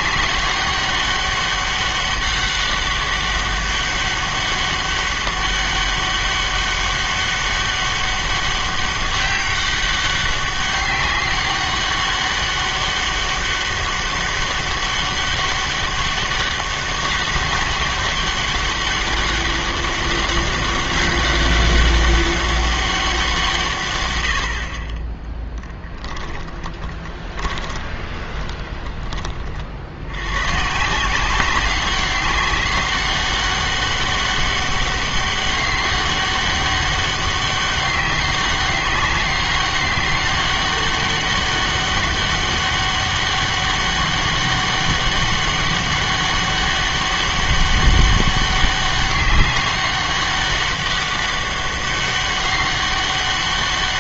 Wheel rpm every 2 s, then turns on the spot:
200, 200, 200, 200, 200, 200, 200, 200, 200, 200, 200, 200, 60, 10, 20, 130, 190, 200, 200, 200, 200, 200, 200, 200, 200, 200, 200.
26-30